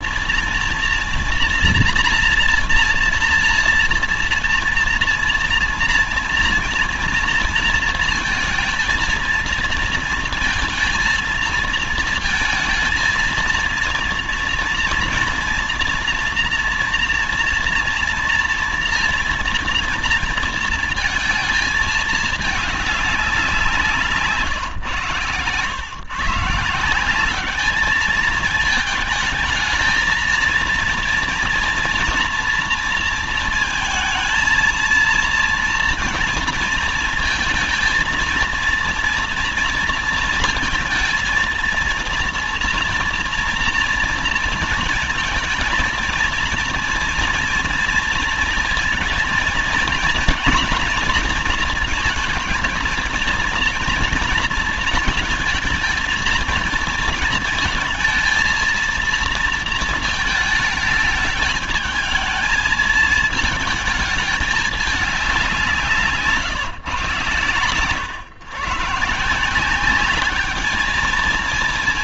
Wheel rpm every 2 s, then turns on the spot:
240, 230, 230, 230, 230, 230, 230, 230, 230, 240, 220, 200, 130, 170, 220, 230, 240, 230, 230, 230, 230, 230, 220, 230, 230, 230, 230, 230, 220, 230, 220, 220, 210, 140, 130, 210.
none